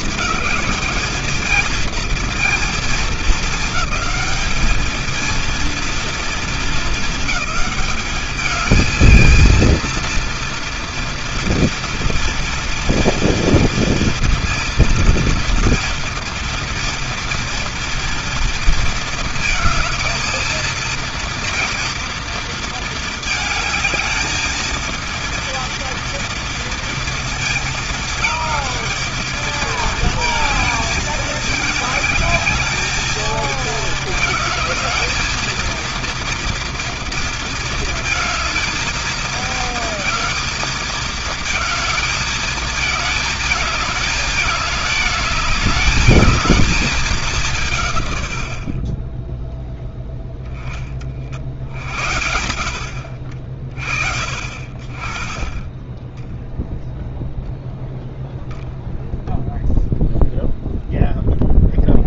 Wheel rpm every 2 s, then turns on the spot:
220, 220, 220, 220, 220, 240, 230, 230, 230, 230, 230, 230, 230, 230, 220, 220, 220, 220, 230, 230, 230, 220, 210, 210, 30, 50, 80, 30, 0, 0, 0.
none